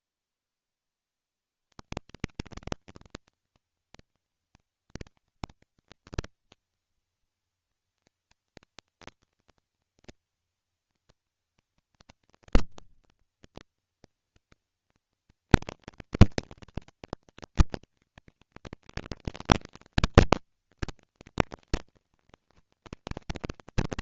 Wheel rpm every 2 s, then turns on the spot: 80, 220, 210, 230, 230, 230, 230, 230, 230, 230, 230, 230.
none